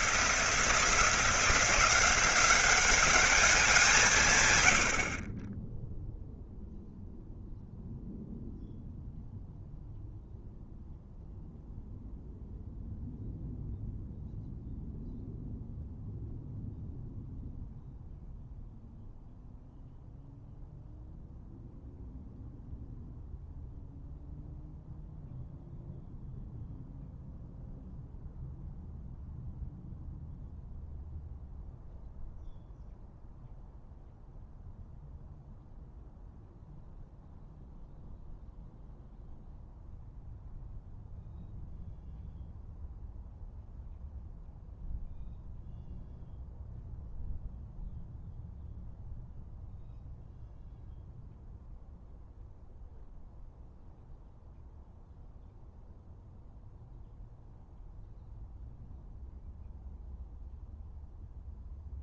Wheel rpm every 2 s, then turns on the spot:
170, 200, 60, 0, 0, 0, 0, 0, 0, 0, 0, 0, 0, 0, 0, 0, 0, 0, 0, 0, 0, 0, 0, 0, 0, 0, 0, 0, 0, 0, 0.
none